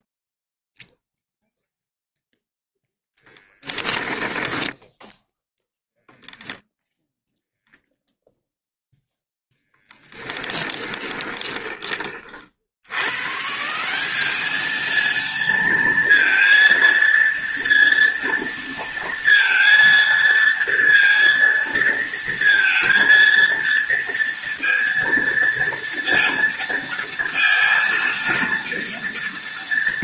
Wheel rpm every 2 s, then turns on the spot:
0, 0, 10, 0, 0, 10, 60, 220, 230, 230, 230, 230, 230, 230, 230.
4-6 10-12